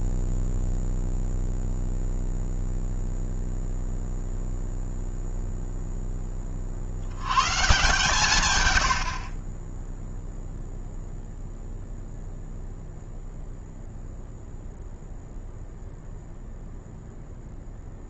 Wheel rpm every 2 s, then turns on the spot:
0, 0, 0, 50, 110, 0, 0, 0, 0.
none